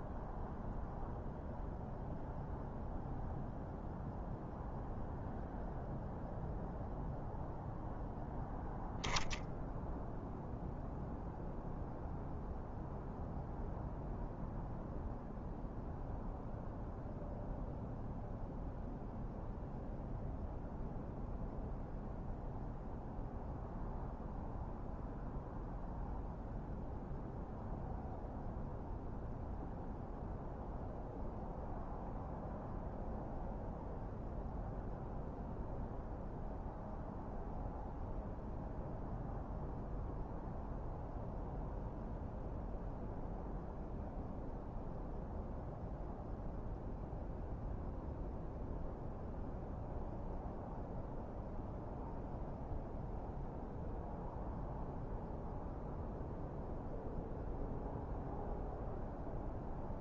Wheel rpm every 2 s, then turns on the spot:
0, 0, 0, 0, 0, 0, 0, 0, 0, 0, 0, 0, 0, 0, 0, 0, 0, 0, 0, 0, 0, 0, 0, 0, 0, 0, 0, 0, 0, 0.
none